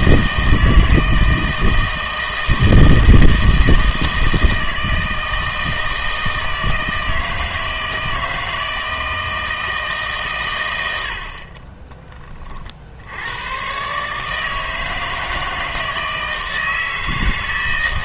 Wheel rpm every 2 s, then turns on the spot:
160, 160, 160, 160, 160, 120, 50, 160, 160.
none